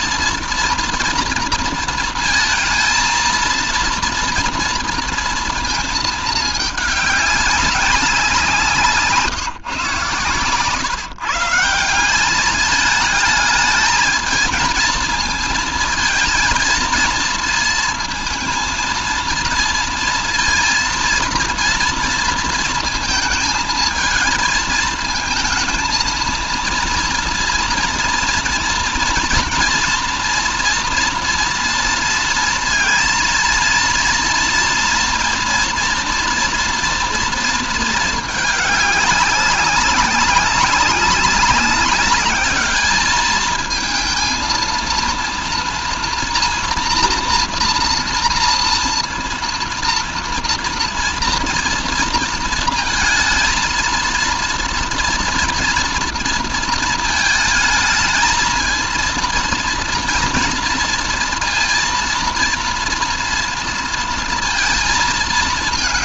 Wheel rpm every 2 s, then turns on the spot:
230, 220, 230, 210, 170, 130, 200, 220, 230, 230, 230, 230, 220, 230, 230, 230, 230, 240, 240, 210, 190, 210, 230, 230, 240, 230, 230, 230, 230, 220, 230, 230, 230.
none